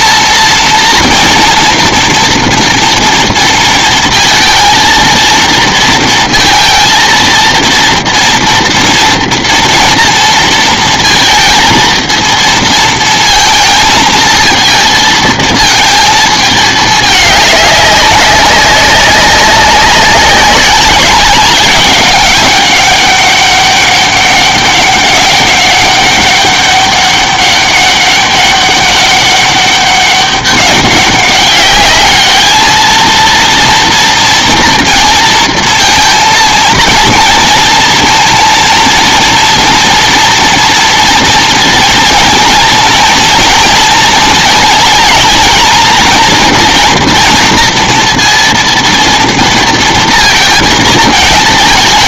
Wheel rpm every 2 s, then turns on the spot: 230, 240, 230, 230, 230, 230, 230, 230, 220, 200, 190, 200, 200, 200, 200, 200, 220, 230, 230, 230, 230, 230, 220, 230, 230, 220.
none